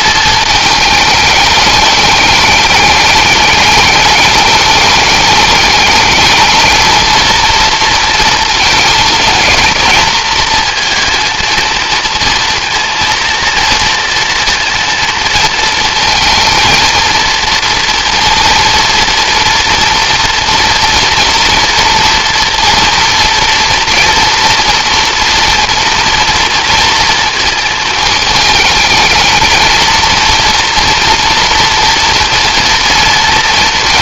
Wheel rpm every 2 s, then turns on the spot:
220, 210, 210, 230, 220, 220, 230, 230, 230, 230, 240, 230, 230, 230, 220, 240, 230.
none